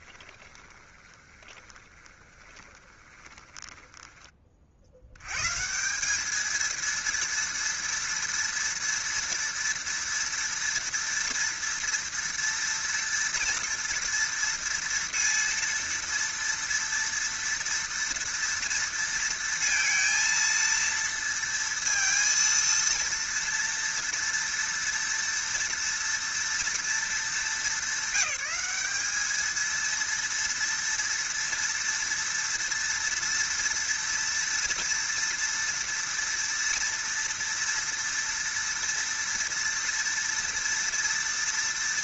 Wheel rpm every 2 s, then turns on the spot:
20, 20, 50, 220, 230, 230, 230, 230, 230, 230, 230, 230, 230, 230, 210, 230, 230, 230, 230, 230, 230.
0-4